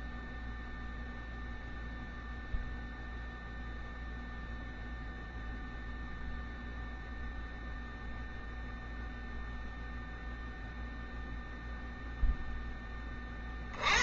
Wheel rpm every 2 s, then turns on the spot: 0, 0, 0, 0, 0, 0, 10.
none